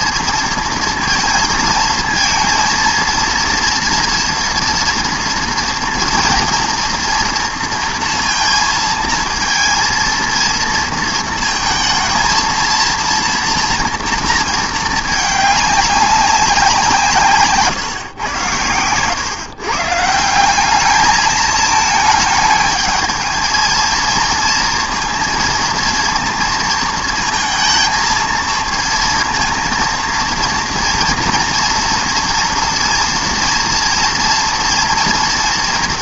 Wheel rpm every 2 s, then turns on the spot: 230, 230, 230, 230, 230, 230, 230, 220, 180, 110, 190, 210, 230, 230, 230, 230, 230, 230.
none